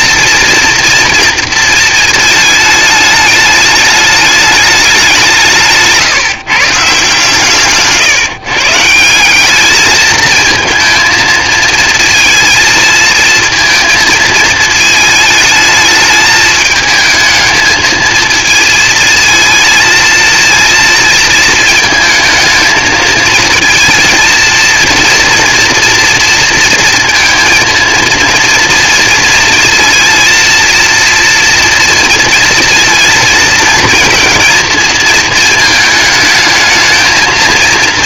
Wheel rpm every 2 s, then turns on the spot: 230, 220, 210, 150, 160, 220, 220, 220, 220, 230, 230, 220, 230, 230, 230, 230, 230, 230, 220.
none